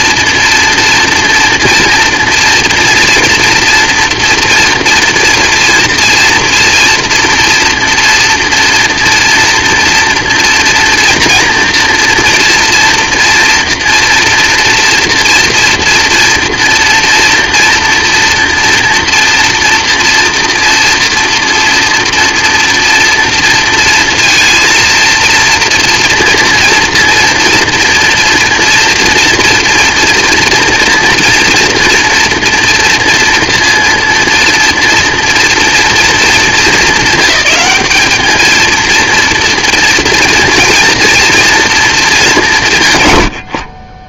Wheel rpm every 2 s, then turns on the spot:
230, 230, 230, 240, 230, 230, 240, 230, 240, 240, 230, 230, 230, 230, 230, 240, 230, 230, 200, 230, 230, 150.
none